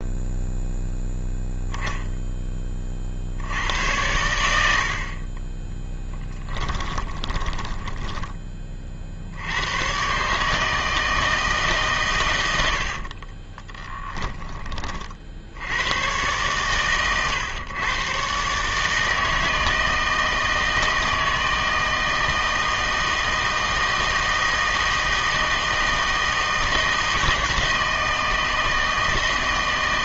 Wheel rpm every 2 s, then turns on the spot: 0, 20, 80, 20, 30, 150, 90, 30, 120, 150, 160, 160, 160, 160, 160.
6-8 12-14